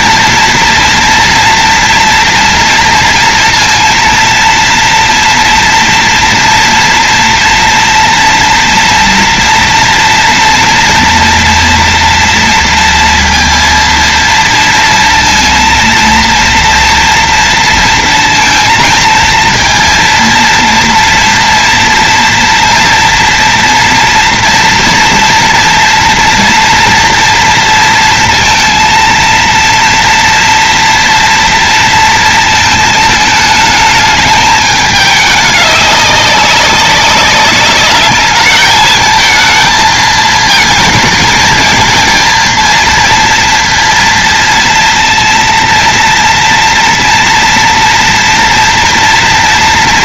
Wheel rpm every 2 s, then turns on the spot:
230, 240, 230, 230, 230, 230, 230, 230, 230, 230, 230, 230, 230, 230, 230, 230, 220, 210, 190, 210, 220, 230, 230, 230, 230.
none